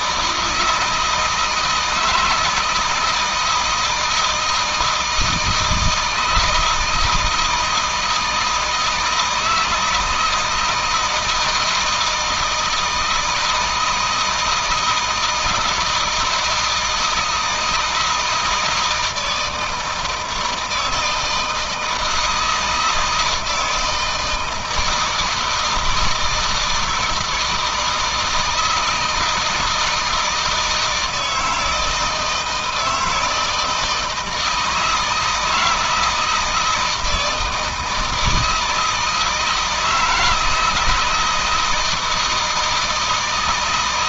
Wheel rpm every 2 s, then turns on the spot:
160, 160, 160, 160, 160, 160, 160, 170, 160, 160, 160, 160, 160, 160, 160, 160, 160, 160, 160, 160, 160, 170.
none